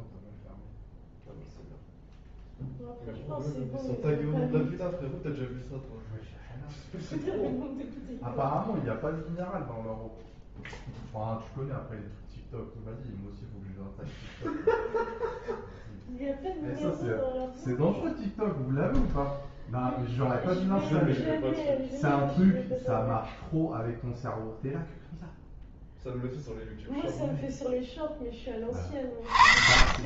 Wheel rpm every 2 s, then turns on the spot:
0, 0, 0, 0, 0, 0, 0, 0, 0, 0, 0, 0, 0, 0, 20.
none